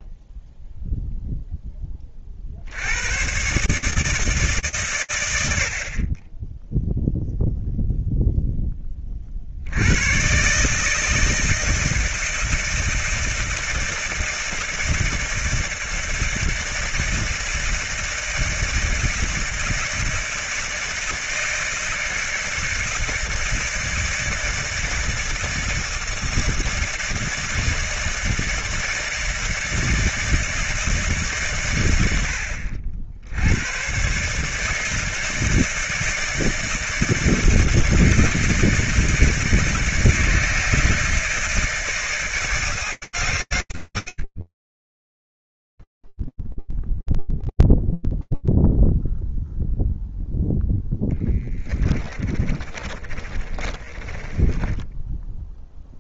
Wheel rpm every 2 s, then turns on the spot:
0, 100, 120, 0, 20, 150, 160, 160, 160, 160, 160, 160, 160, 160, 160, 160, 70, 160, 160, 160, 160, 160, 20, 0, 0, 0, 30, 10.
52-54